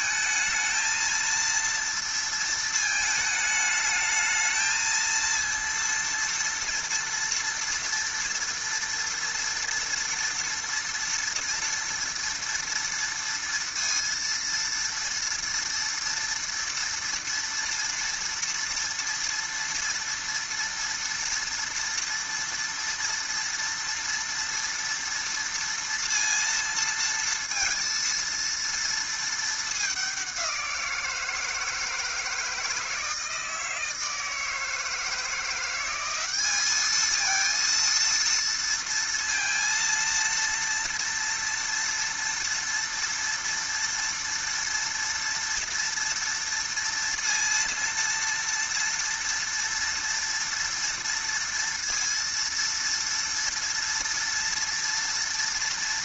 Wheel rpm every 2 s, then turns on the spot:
220, 220, 220, 240, 230, 230, 230, 230, 230, 230, 230, 230, 230, 230, 230, 180, 160, 160, 210, 230, 230, 230, 230, 230, 230, 230, 230, 230.
none